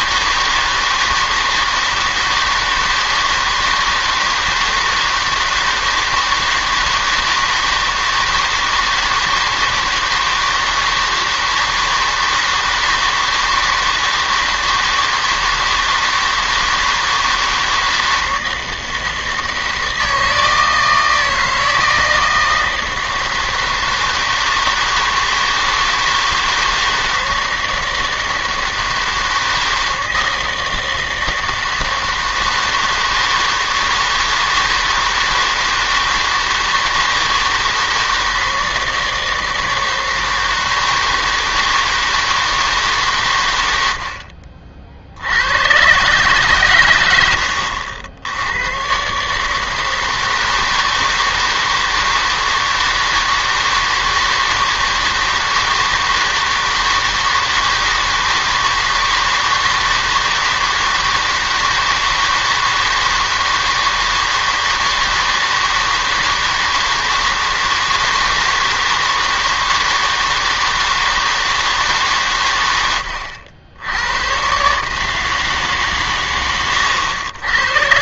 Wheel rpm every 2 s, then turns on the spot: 160, 160, 160, 160, 160, 160, 160, 160, 160, 160, 160, 160, 160, 160, 160, 160, 160, 160, 160, 160, 160, 150, 60, 130, 100, 160, 160, 160, 160, 160, 160, 160, 160, 160, 160, 160, 110, 140, 100.
none